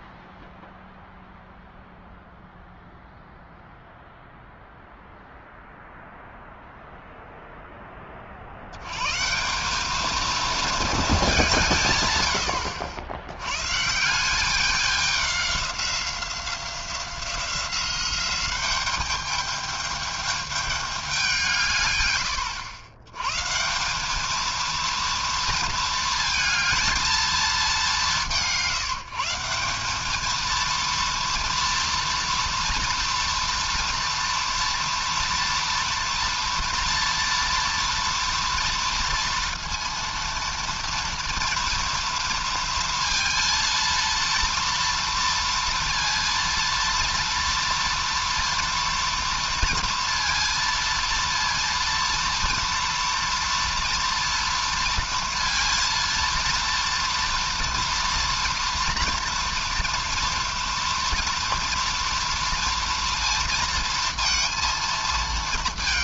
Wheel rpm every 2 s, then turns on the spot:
0, 0, 0, 0, 70, 220, 80, 190, 180, 200, 210, 100, 220, 220, 140, 230, 230, 230, 230, 230, 230, 230, 230, 230, 230, 230, 230, 230, 230, 230, 240, 230, 230.
none